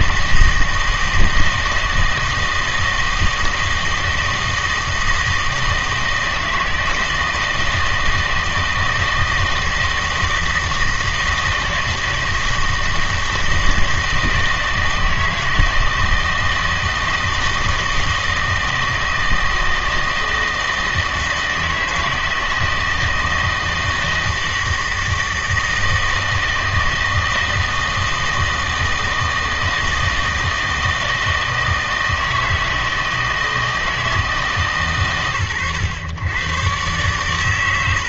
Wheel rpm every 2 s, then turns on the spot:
160, 160, 160, 160, 160, 160, 160, 160, 160, 160, 160, 160, 160, 160, 160, 160, 160, 140, 120.
none